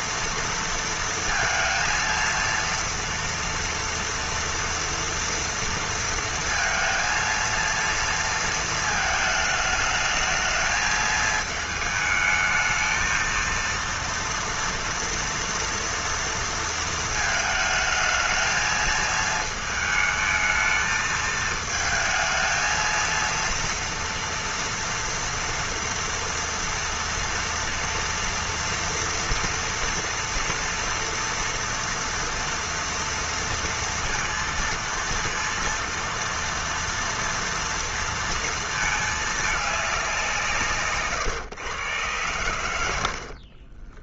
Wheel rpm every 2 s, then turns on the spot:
230, 230, 230, 230, 220, 220, 220, 240, 230, 220, 220, 230, 230, 230, 230, 230, 230, 230, 230, 230, 150, 100.
none